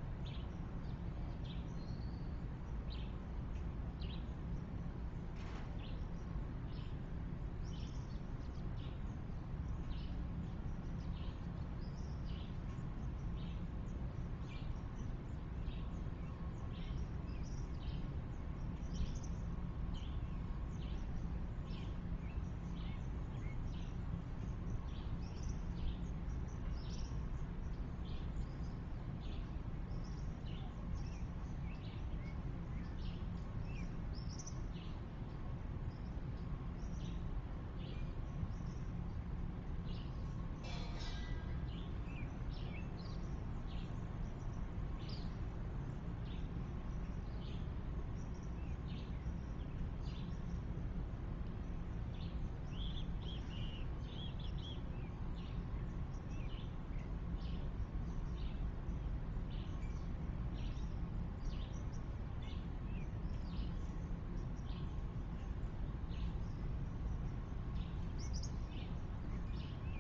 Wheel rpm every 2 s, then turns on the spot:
0, 0, 0, 0, 0, 0, 0, 0, 0, 0, 0, 0, 0, 0, 0, 0, 0, 0, 0, 0, 0, 0, 0, 0, 0, 0, 0, 0, 0, 0, 0, 0, 0, 0, 0.
none